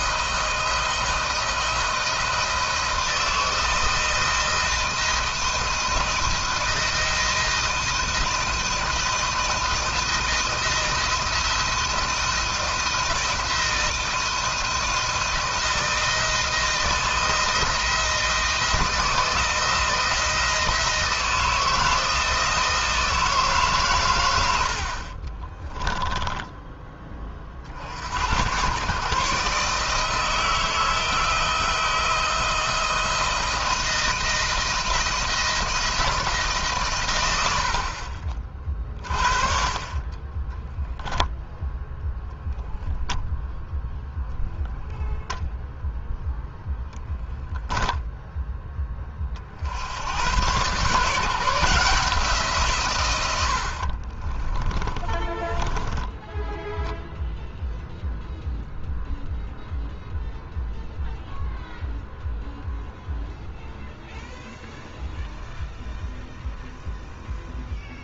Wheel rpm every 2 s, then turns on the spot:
160, 160, 160, 160, 160, 170, 160, 160, 160, 160, 170, 160, 40, 30, 130, 160, 160, 160, 120, 40, 0, 0, 0, 0, 30, 140, 130, 20, 0, 0, 0, 0, 0, 0.
24-26 54-56